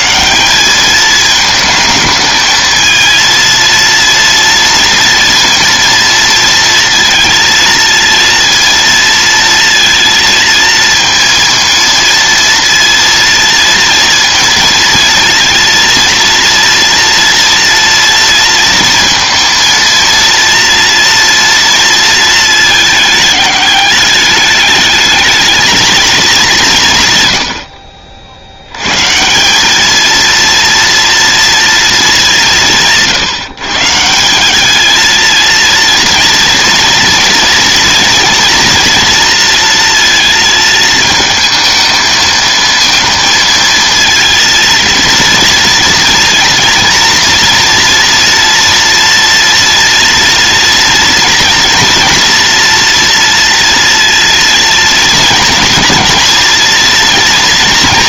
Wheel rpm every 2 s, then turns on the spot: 210, 220, 230, 230, 230, 230, 230, 230, 230, 230, 230, 220, 220, 150, 110, 230, 170, 220, 230, 230, 220, 220, 230, 230, 230, 240, 230, 230, 230.
none